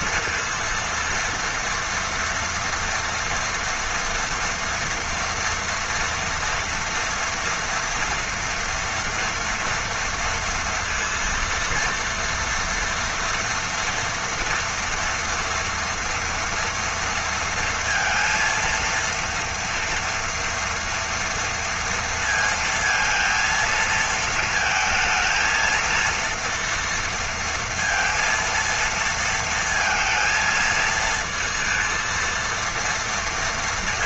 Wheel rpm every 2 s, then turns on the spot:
230, 230, 230, 230, 230, 230, 230, 240, 230, 230, 230, 230, 230, 230, 230, 230, 230.
none